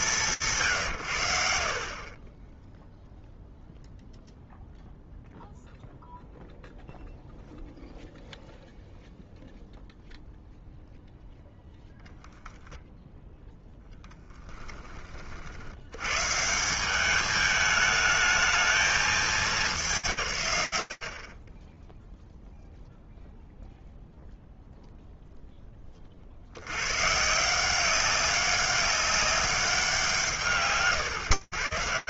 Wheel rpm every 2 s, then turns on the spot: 130, 0, 0, 0, 0, 0, 10, 10, 180, 220, 110, 0, 0, 130, 200, 120.
none